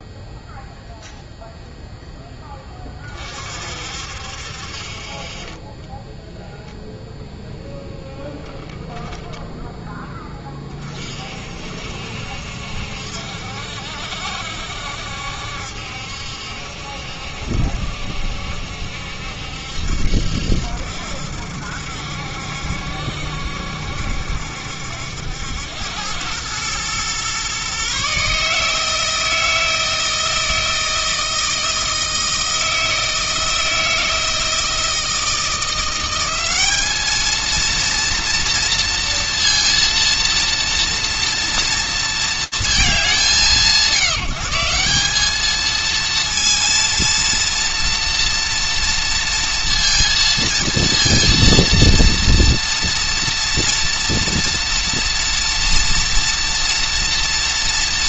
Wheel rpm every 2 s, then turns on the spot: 0, 20, 30, 0, 0, 30, 70, 70, 70, 70, 70, 70, 70, 110, 160, 160, 160, 160, 210, 230, 230, 200, 180, 230, 230, 230, 230, 230, 230.
4-6